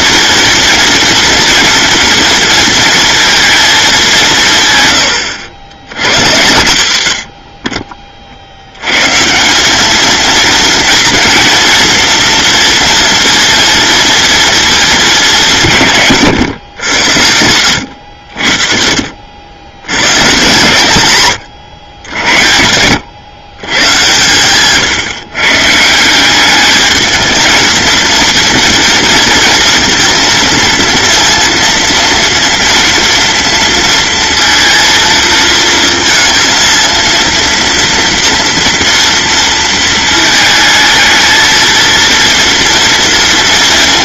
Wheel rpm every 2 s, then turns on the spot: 230, 230, 130, 120, 90, 230, 230, 230, 110, 60, 120, 90, 120, 210, 230, 230, 230, 230, 230, 230, 220, 230.
none